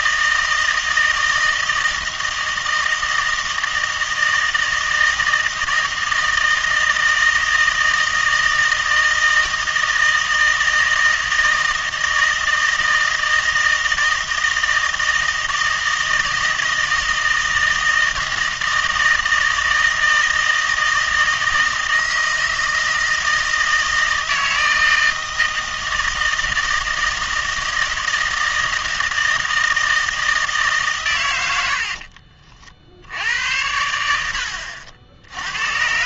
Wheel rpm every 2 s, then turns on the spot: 160, 160, 160, 160, 160, 160, 160, 160, 160, 160, 160, 160, 160, 160, 160, 150, 40, 70.
none